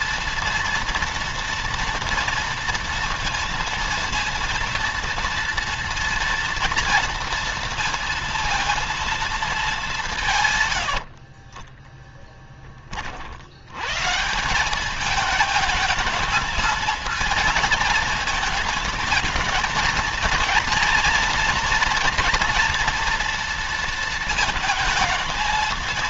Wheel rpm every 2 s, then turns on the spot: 240, 230, 230, 230, 230, 70, 30, 200, 230, 220, 230, 230, 220.
10-12